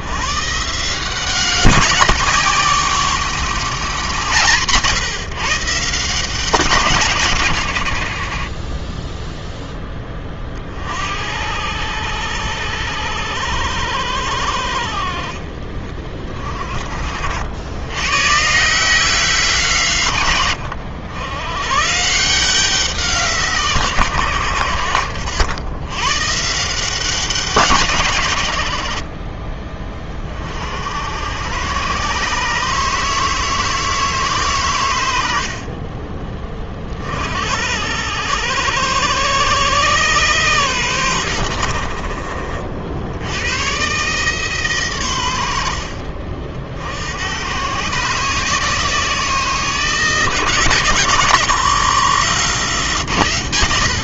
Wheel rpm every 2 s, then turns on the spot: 150, 170, 150, 160, 20, 50, 90, 60, 40, 160, 90, 180, 90, 160, 80, 70, 150, 120, 30, 100, 110, 60, 130, 70, 160, 150, 130.
28-30